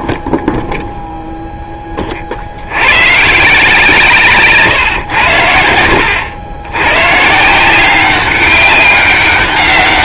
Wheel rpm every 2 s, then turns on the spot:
0, 80, 130, 110, 200.
none